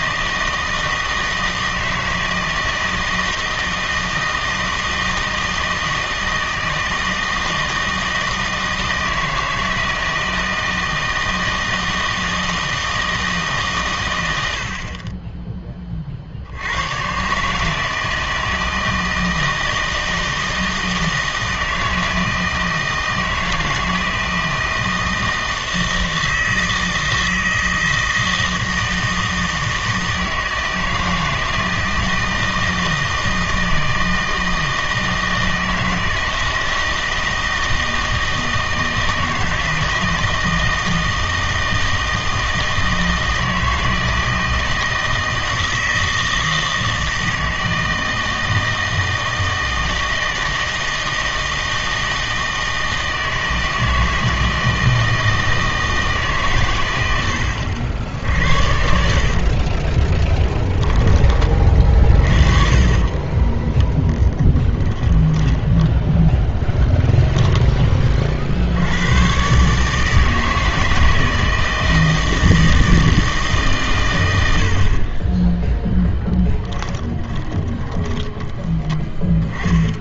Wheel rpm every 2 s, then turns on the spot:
160, 160, 160, 160, 160, 160, 160, 70, 80, 160, 160, 160, 160, 160, 160, 160, 160, 160, 160, 160, 160, 160, 160, 160, 160, 160, 160, 160, 130, 60, 10, 30, 10, 10, 70, 160, 160, 70, 10, 10.
60-64 66-68 76-80